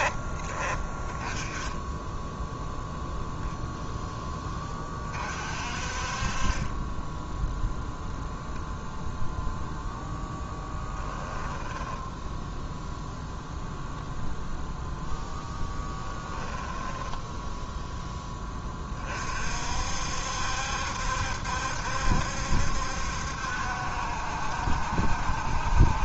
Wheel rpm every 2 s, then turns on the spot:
20, 0, 20, 20, 0, 10, 0, 0, 10, 20, 70, 70, 60.
10-12 16-18